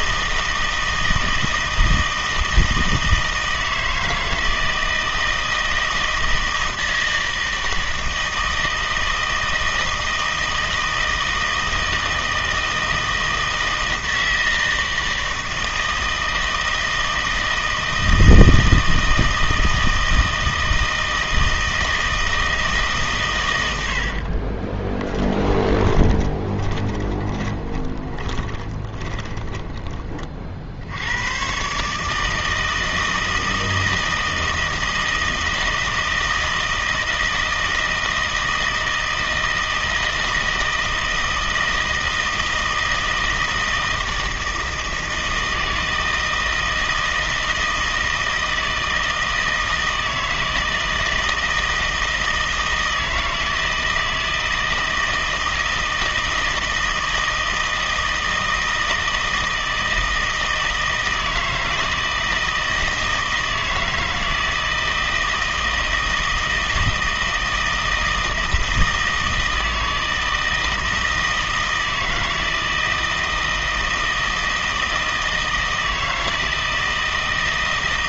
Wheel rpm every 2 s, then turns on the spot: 160, 160, 160, 160, 160, 160, 160, 160, 160, 160, 160, 150, 20, 20, 20, 70, 160, 160, 160, 160, 160, 160, 160, 160, 160, 160, 160, 160, 160, 160, 160, 160, 160, 160, 160, 160, 160, 160, 160.
24-30